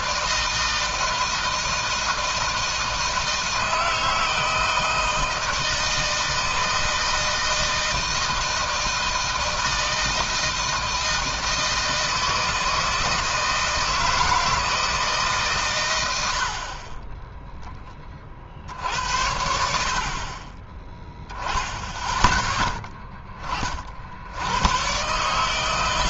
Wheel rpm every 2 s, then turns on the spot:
160, 160, 160, 160, 160, 160, 160, 160, 40, 60, 30, 10, 110.
none